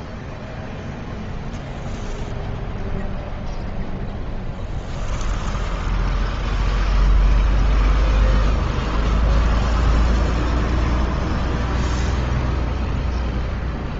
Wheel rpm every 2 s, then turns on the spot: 0, 0, 10, 0, 0, 0, 0.
none